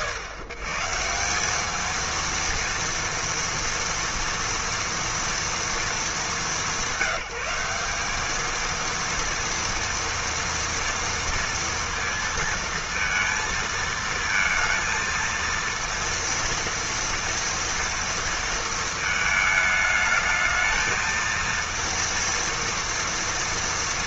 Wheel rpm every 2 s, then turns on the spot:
140, 230, 230, 180, 230, 230, 230, 230, 230, 220, 220, 230.
none